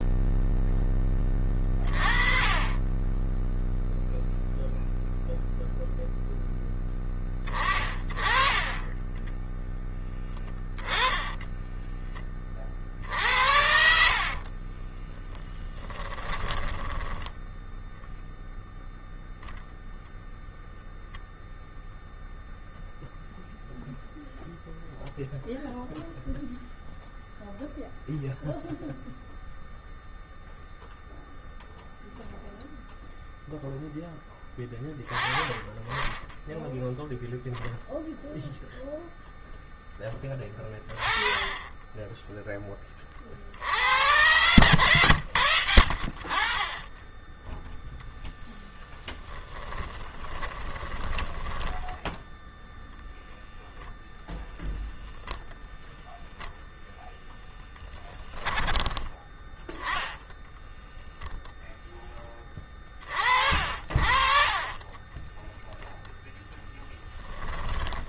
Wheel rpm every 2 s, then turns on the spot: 0, 20, 0, 10, 20, 20, 30, 30, 20, 0, 0, 0, 0, 0, 0, 0, 0, 10, 0, 0, 10, 10, 110, 40, 10, 20, 10, 0, 0, 30, 10, 20, 20, 10.
10-12 14-16 44-46 50-52 58-60 64-66